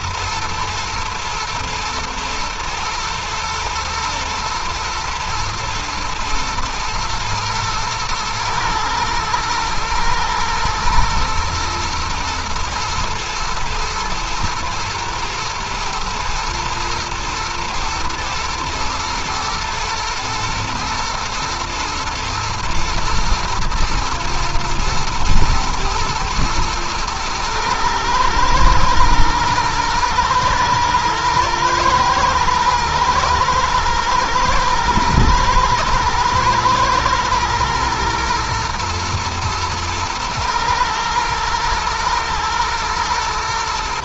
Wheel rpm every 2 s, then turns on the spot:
110, 120, 110, 110, 110, 120, 110, 110, 120, 110, 120, 110, 110, 120, 120, 110, 110, 110, 120, 110, 110, 110.
none